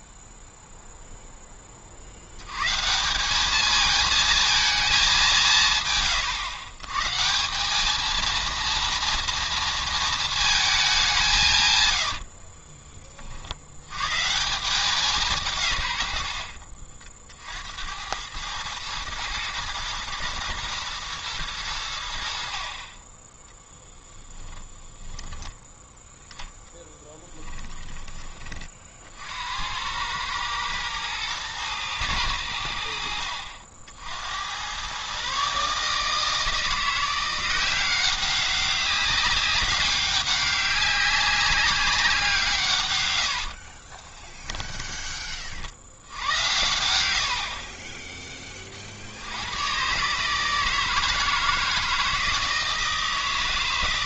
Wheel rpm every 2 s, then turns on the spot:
0, 140, 220, 120, 230, 210, 30, 180, 60, 110, 120, 40, 20, 10, 50, 110, 80, 100, 170, 190, 190, 130, 10, 90, 40, 160, 160.
12-14 24-28 44-46